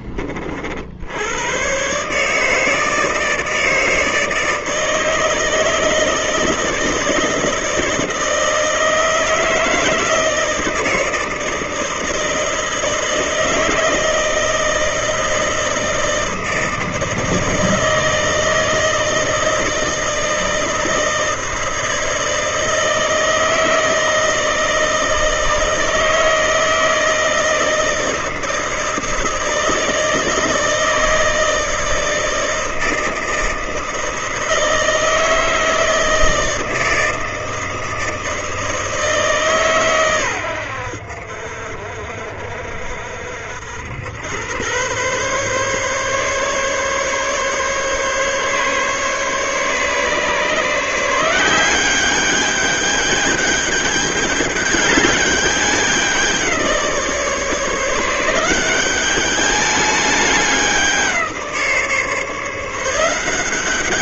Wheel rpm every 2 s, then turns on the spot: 50, 150, 160, 160, 160, 160, 160, 160, 160, 160, 160, 160, 160, 160, 160, 160, 160, 160, 160, 160, 90, 60, 110, 140, 140, 150, 200, 210, 170, 180, 190, 160.
none